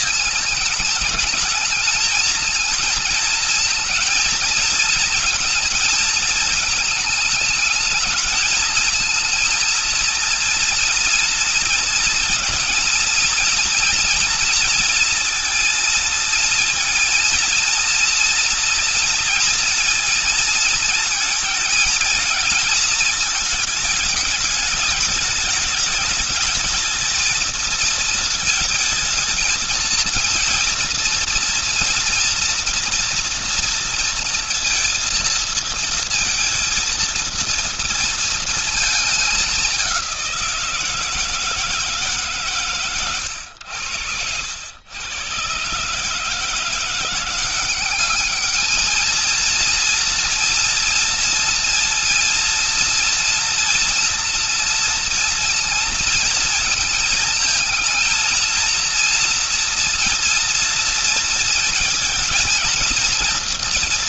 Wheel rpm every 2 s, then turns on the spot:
210, 220, 230, 220, 220, 230, 230, 230, 230, 230, 220, 220, 220, 220, 220, 230, 240, 230, 230, 230, 180, 150, 100, 160, 210, 230, 230, 230, 230, 230, 230, 230.
none